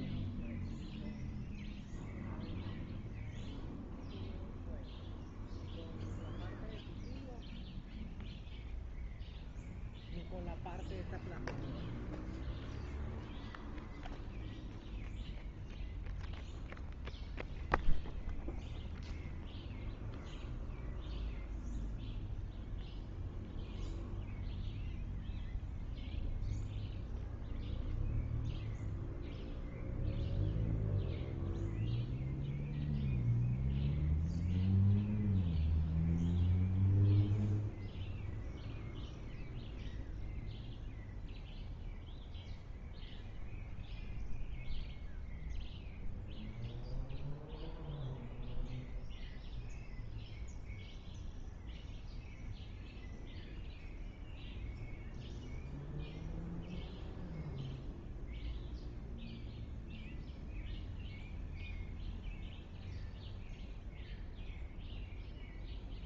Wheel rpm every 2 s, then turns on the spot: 0, 0, 0, 0, 0, 0, 0, 0, 0, 0, 0, 0, 0, 0, 0, 0, 0, 0, 0, 0, 0, 0, 0, 0, 0, 0, 0, 0, 0, 0, 0, 0, 0.
none